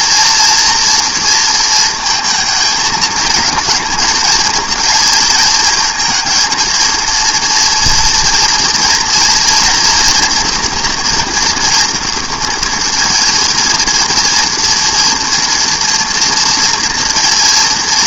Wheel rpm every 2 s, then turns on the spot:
230, 220, 230, 230, 230, 240, 230, 230, 230.
none